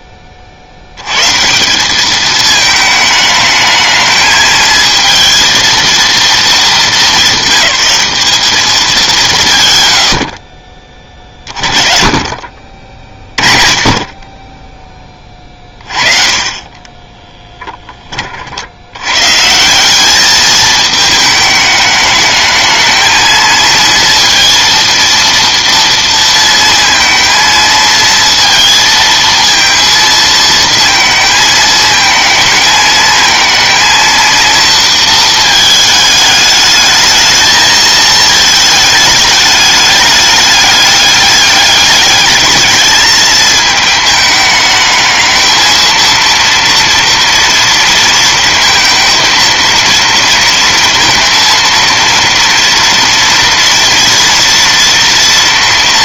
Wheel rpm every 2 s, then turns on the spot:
40, 210, 220, 220, 210, 30, 40, 10, 30, 50, 210, 220, 230, 230, 230, 220, 220, 230, 210, 220, 200, 210, 210, 230, 230, 230, 230, 230.
none